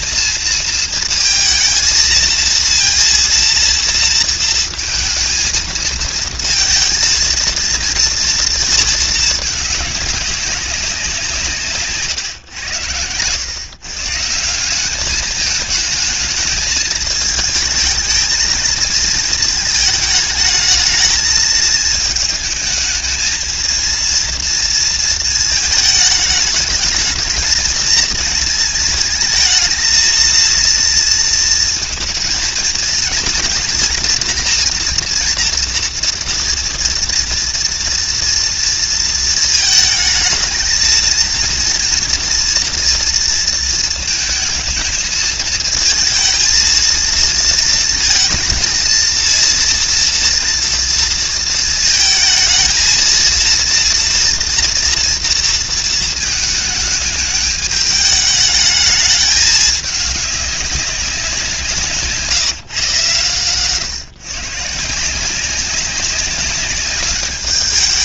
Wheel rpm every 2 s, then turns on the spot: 220, 230, 230, 230, 230, 190, 100, 200, 220, 230, 220, 220, 230, 220, 220, 230, 230, 230, 230, 230, 230, 230, 220, 230, 230, 230, 230, 230, 210, 210, 200, 140, 160, 200.
none